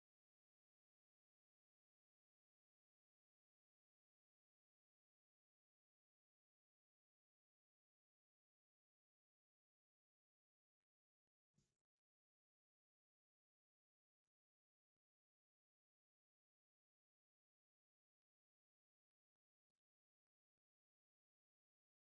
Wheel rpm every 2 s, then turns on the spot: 0, 0, 0, 0, 0, 0, 0, 0, 0, 0, 0.
none